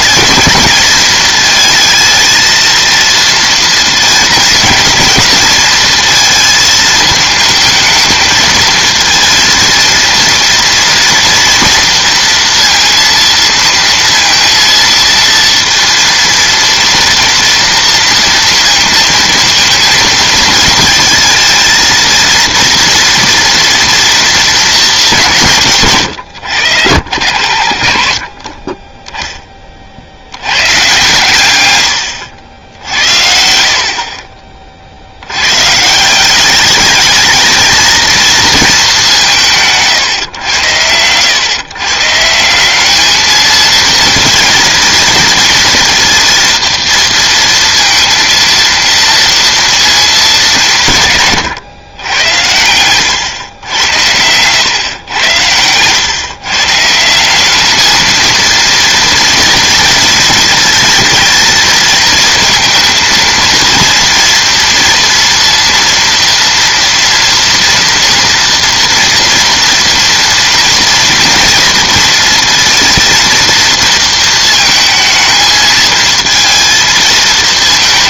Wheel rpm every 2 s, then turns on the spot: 210, 220, 220, 220, 220, 230, 230, 230, 230, 230, 220, 230, 230, 120, 50, 100, 80, 50, 200, 220, 110, 190, 230, 230, 230, 180, 100, 130, 150, 230, 230, 230, 230, 240, 230, 230, 230, 230, 220.
52-54